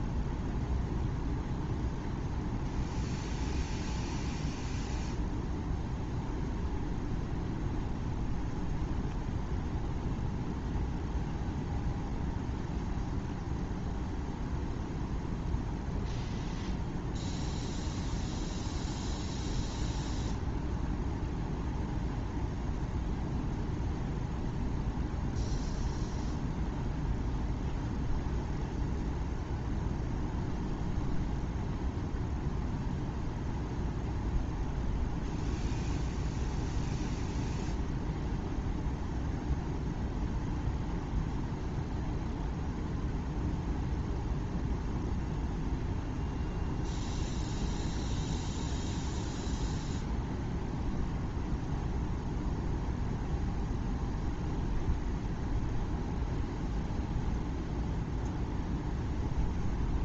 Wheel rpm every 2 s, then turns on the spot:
0, 0, 0, 0, 0, 0, 0, 0, 0, 0, 0, 0, 0, 0, 0, 0, 0, 0, 0, 0, 0, 0, 0, 0, 0, 0, 0, 0, 0, 0.
none